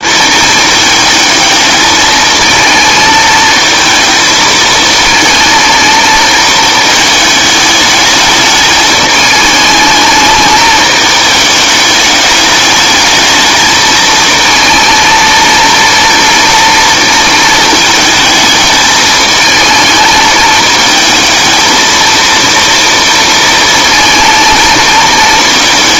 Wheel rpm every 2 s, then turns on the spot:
220, 220, 230, 220, 210, 220, 210, 230, 230, 220, 220, 230, 230.
none